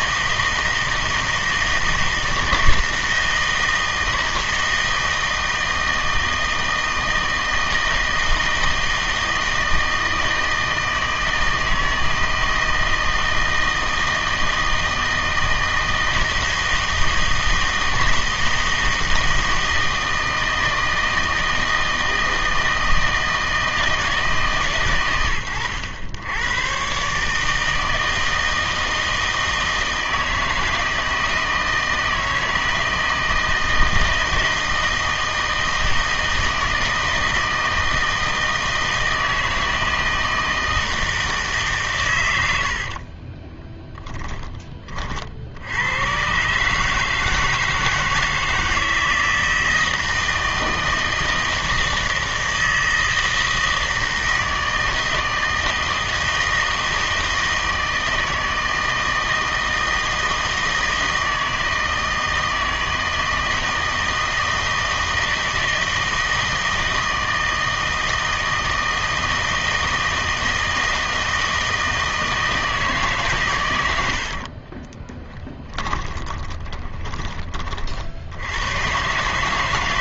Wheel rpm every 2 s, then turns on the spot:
160, 160, 160, 160, 160, 160, 160, 160, 160, 160, 160, 160, 130, 110, 160, 160, 160, 160, 160, 160, 160, 80, 20, 130, 160, 160, 160, 160, 160, 160, 160, 160, 160, 160, 160, 160, 160, 40, 20, 100.
42-44 74-78